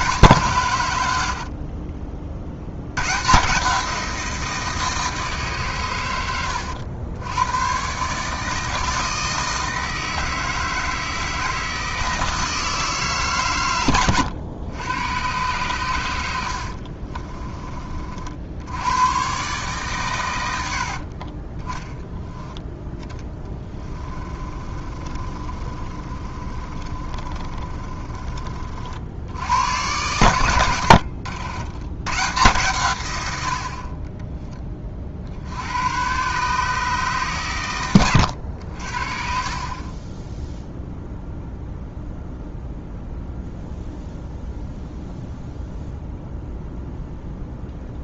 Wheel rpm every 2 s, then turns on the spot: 110, 100, 160, 80, 160, 160, 160, 100, 50, 100, 60, 20, 30, 30, 60, 90, 110, 30, 150, 60, 0, 0, 0, 0.
16-18 20-22 24-28 30-32